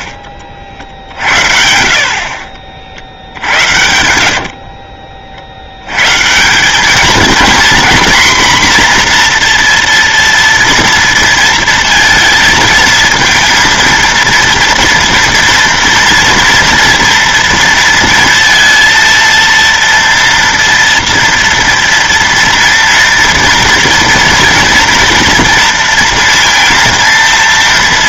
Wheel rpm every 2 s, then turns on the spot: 50, 40, 60, 200, 240, 230, 230, 230, 230, 230, 230, 230, 230, 230.
2-6